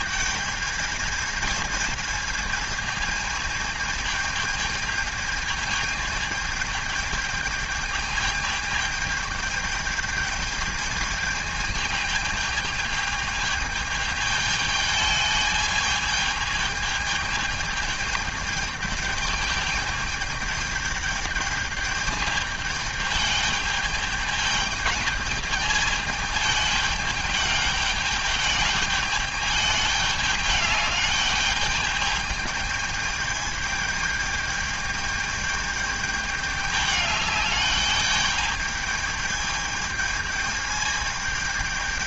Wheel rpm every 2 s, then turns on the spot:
220, 220, 220, 210, 210, 220, 220, 210, 220, 210, 210, 210, 210, 210, 210, 210, 210, 210, 210, 210, 220.
none